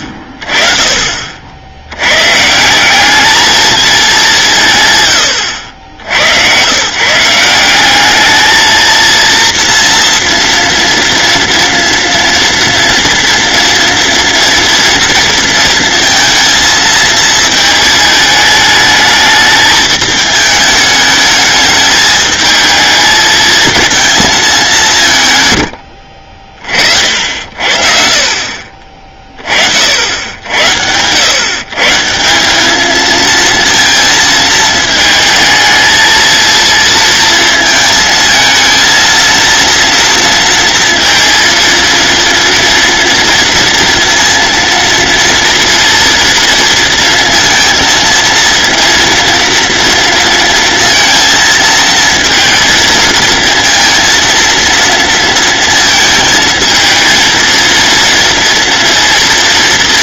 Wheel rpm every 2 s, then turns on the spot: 40, 180, 130, 150, 230, 230, 230, 230, 220, 220, 220, 220, 180, 50, 30, 100, 220, 220, 230, 230, 230, 230, 230, 230, 230, 230, 230, 230, 220, 230.
none